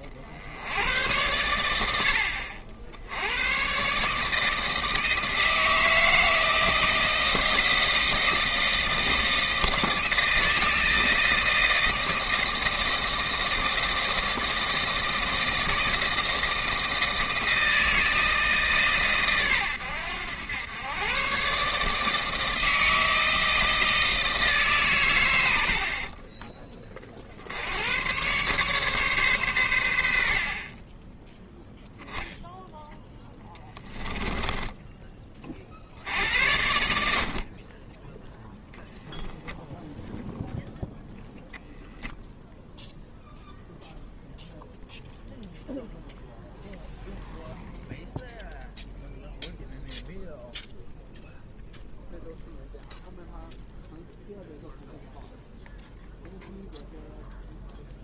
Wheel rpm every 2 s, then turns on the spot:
90, 70, 160, 160, 160, 160, 160, 160, 160, 140, 110, 160, 140, 20, 140, 30, 0, 10, 70, 0, 0, 0, 0, 0, 0, 0, 0, 0, 0.
34-36